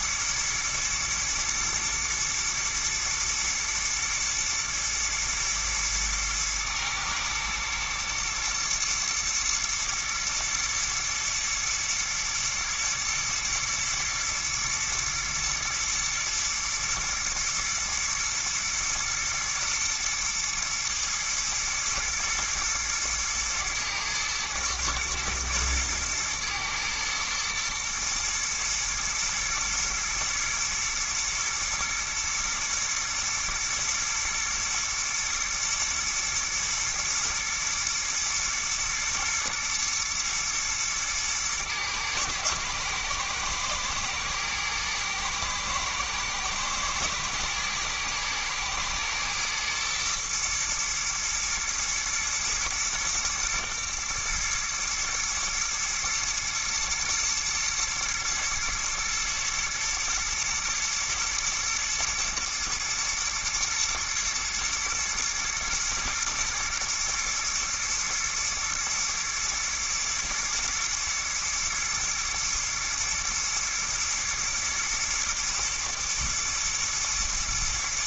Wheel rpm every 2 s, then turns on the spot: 110, 110, 110, 110, 110, 120, 120, 110, 110, 120, 110, 110, 120, 110, 120, 120, 110, 110, 110, 110, 110, 110, 110, 110, 120, 110, 110, 120, 120, 120, 120, 110, 110, 110, 120, 120, 110, 120, 110.
none